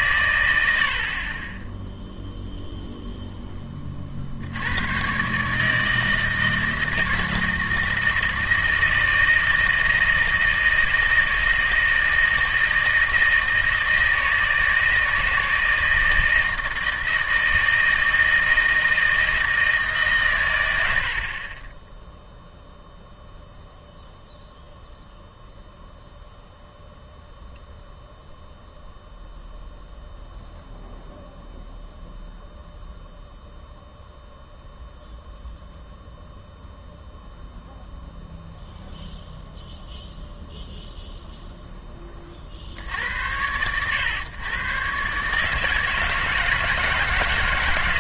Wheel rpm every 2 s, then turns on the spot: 90, 0, 80, 160, 160, 160, 160, 160, 160, 160, 100, 0, 0, 0, 0, 0, 0, 0, 0, 0, 0, 50, 120, 160.
none